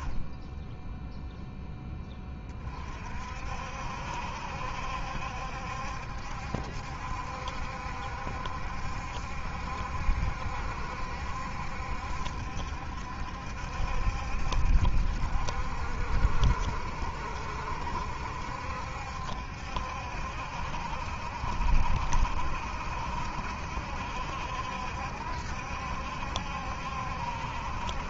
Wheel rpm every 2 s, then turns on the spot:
10, 60, 70, 70, 70, 70, 70, 70, 70, 70, 70, 70, 70, 70.
none